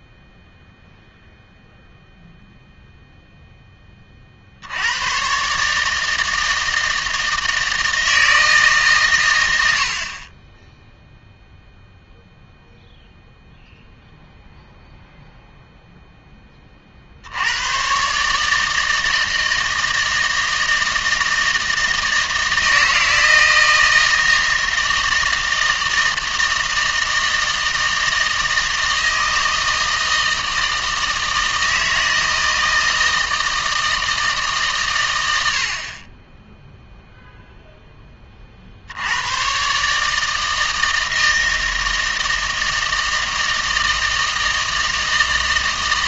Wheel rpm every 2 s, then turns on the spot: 0, 0, 80, 160, 150, 10, 0, 0, 40, 160, 160, 160, 160, 160, 160, 160, 160, 140, 0, 60, 160, 160, 160.
none